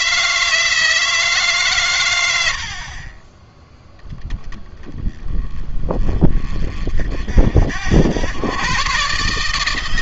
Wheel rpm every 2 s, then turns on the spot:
160, 60, 10, 40, 120.
none